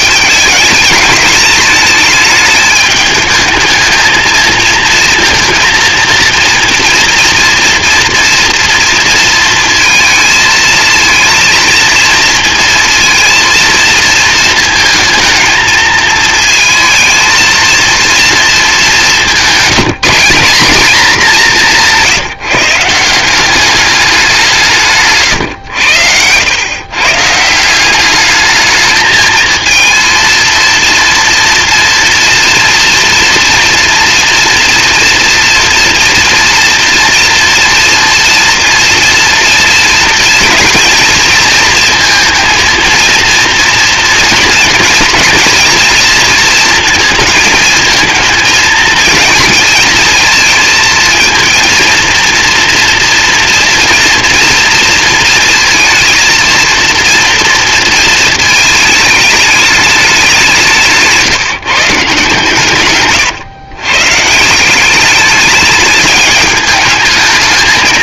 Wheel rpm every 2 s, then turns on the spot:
220, 220, 220, 230, 230, 220, 230, 220, 220, 210, 210, 150, 180, 120, 220, 230, 230, 230, 230, 230, 240, 230, 230, 230, 230, 230, 230, 230, 230, 220, 170, 140, 170, 210.
none